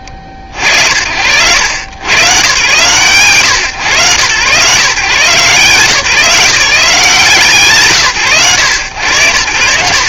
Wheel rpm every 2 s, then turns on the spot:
50, 120, 140, 170, 100.
none